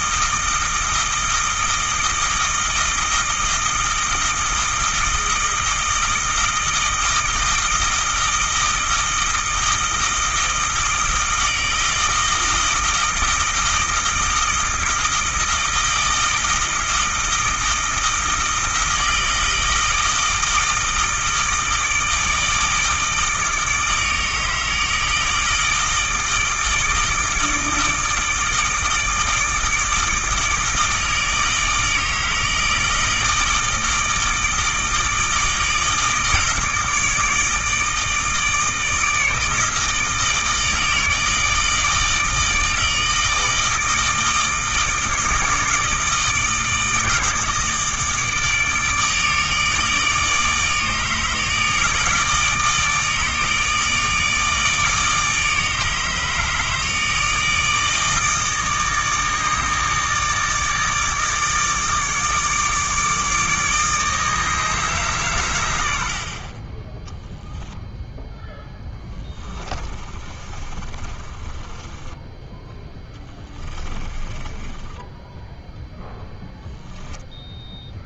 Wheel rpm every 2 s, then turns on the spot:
160, 160, 160, 160, 160, 160, 160, 160, 160, 160, 160, 160, 160, 160, 160, 160, 160, 160, 160, 160, 160, 160, 160, 160, 150, 160, 150, 150, 150, 160, 160, 150, 150, 20, 10, 30, 10, 20, 0.
70-72 74-76